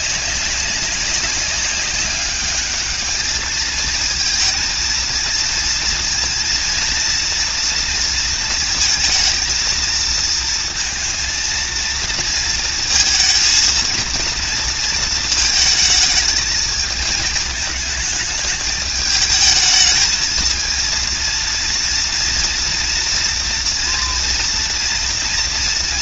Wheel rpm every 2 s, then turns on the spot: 190, 210, 230, 230, 230, 230, 230, 230, 230, 210, 230, 230, 230.
none